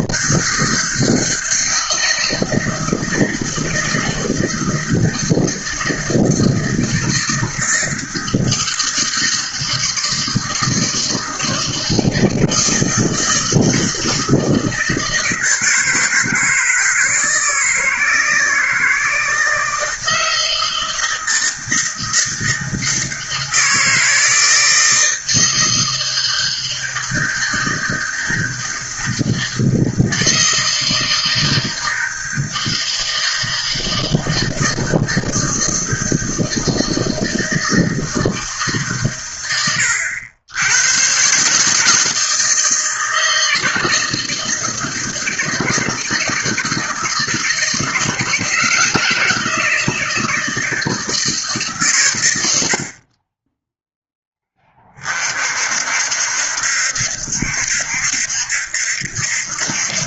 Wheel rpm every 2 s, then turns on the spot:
160, 160, 160, 160, 160, 160, 160, 160, 160, 160, 160, 160, 160, 160, 160, 160, 160, 160, 160, 140, 110, 160, 160, 160, 160, 160, 50, 30, 70, 70.
none